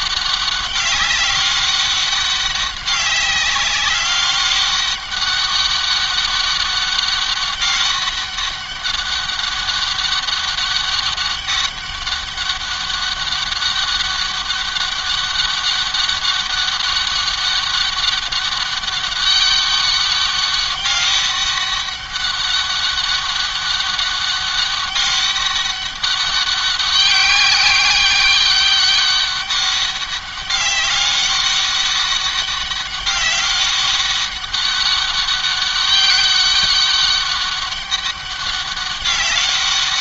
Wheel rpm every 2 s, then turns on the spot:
200, 200, 200, 200, 200, 200, 200, 200, 200, 200, 200, 200, 200, 200, 190, 200, 200, 200, 200, 200.
none